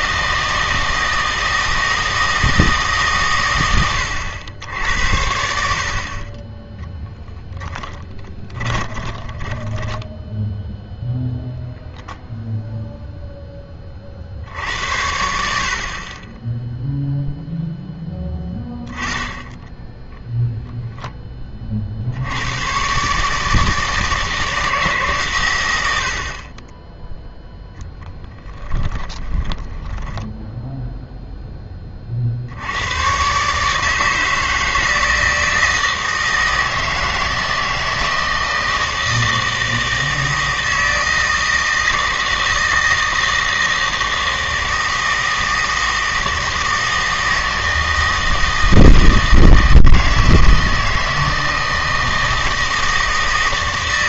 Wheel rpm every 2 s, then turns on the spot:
160, 160, 80, 10, 10, 0, 0, 70, 0, 10, 0, 110, 160, 30, 10, 0, 80, 160, 160, 160, 160, 160, 160, 160, 160, 160, 160.
8-10 28-30